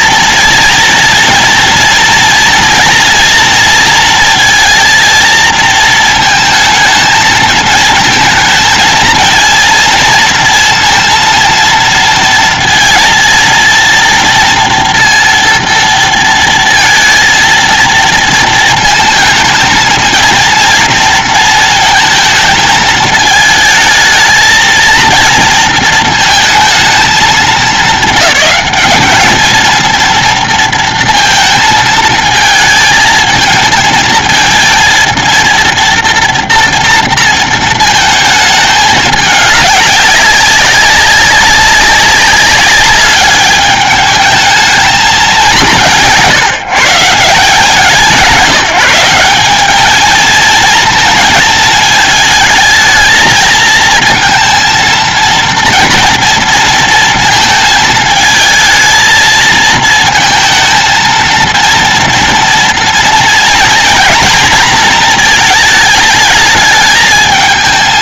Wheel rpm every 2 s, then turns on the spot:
230, 230, 230, 220, 230, 230, 230, 230, 230, 230, 230, 220, 230, 220, 210, 230, 220, 230, 230, 210, 200, 200, 210, 150, 180, 230, 220, 230, 230, 220, 230, 230, 220, 220.
none